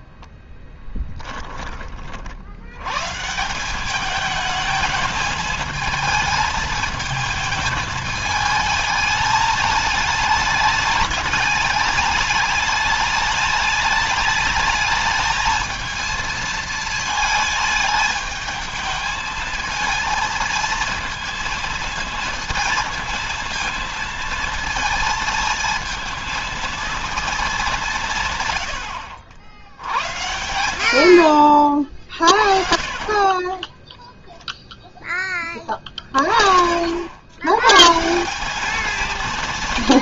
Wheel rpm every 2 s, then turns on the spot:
10, 110, 220, 220, 210, 210, 210, 220, 220, 220, 230, 230, 230, 220, 80, 80, 50, 10, 80, 190.
0-2 32-34